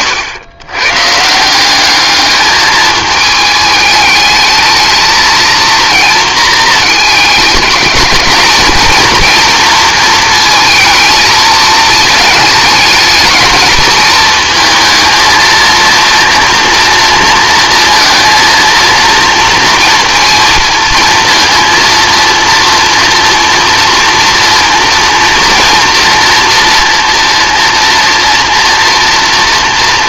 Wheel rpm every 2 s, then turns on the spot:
120, 210, 220, 220, 220, 220, 220, 230, 230, 230, 230, 230, 230, 230, 230.
none